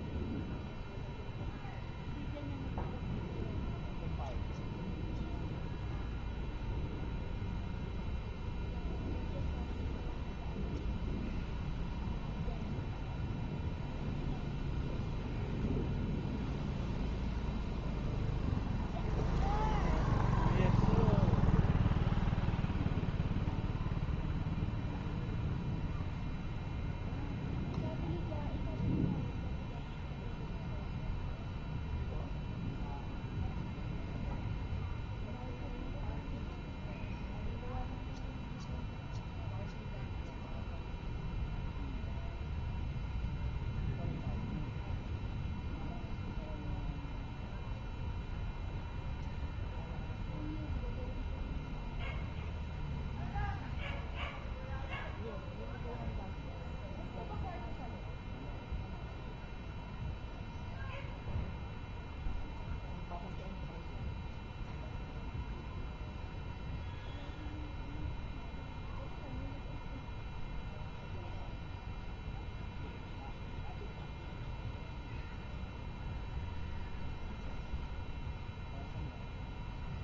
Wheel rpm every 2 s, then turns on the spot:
0, 0, 0, 0, 0, 0, 0, 0, 0, 0, 0, 0, 0, 0, 0, 0, 0, 0, 0, 0, 0, 0, 0, 0, 0, 0, 0, 0, 0, 0, 0, 0, 0, 0, 0, 0, 0, 0, 0, 0.
none